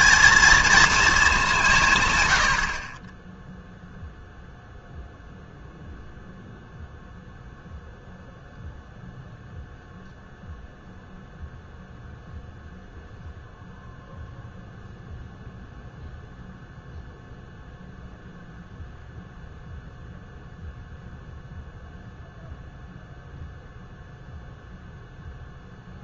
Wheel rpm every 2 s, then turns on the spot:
230, 80, 0, 0, 0, 0, 0, 0, 0, 0, 0, 0, 0.
none